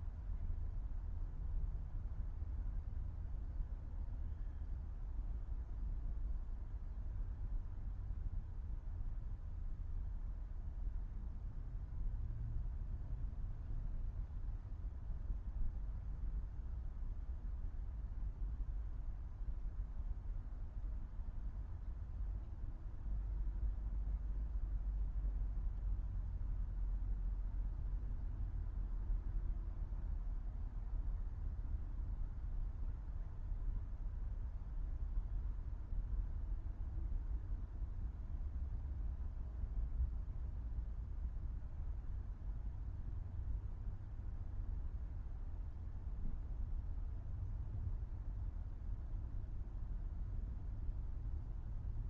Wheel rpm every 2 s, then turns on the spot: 0, 0, 0, 0, 0, 0, 0, 0, 0, 0, 0, 0, 0, 0, 0, 0, 0, 0, 0, 0, 0, 0, 0, 0, 0, 0.
none